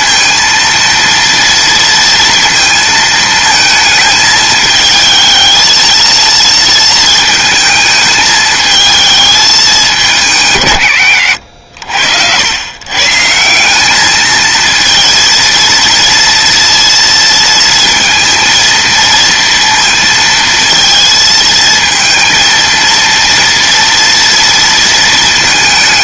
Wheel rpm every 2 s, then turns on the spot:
230, 230, 220, 230, 220, 120, 110, 230, 230, 230, 230, 230, 230.
none